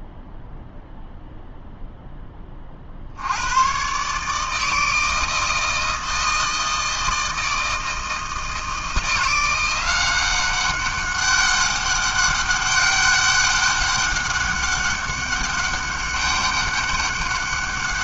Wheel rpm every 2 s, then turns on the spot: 0, 20, 150, 160, 160, 190, 200, 200, 200.
none